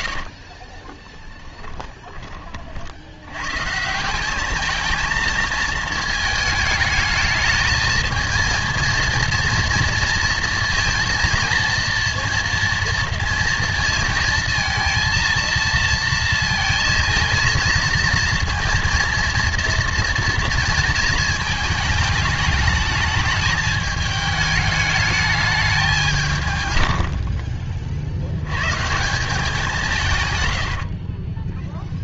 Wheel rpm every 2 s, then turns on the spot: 30, 50, 220, 220, 230, 230, 230, 230, 220, 230, 230, 220, 210, 110, 120, 100.
0-2 30-32